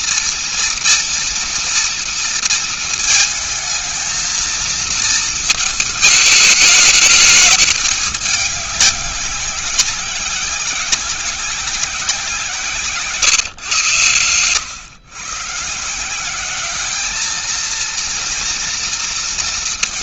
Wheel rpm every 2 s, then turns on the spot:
230, 230, 230, 220, 210, 190, 170, 120, 200, 230.
none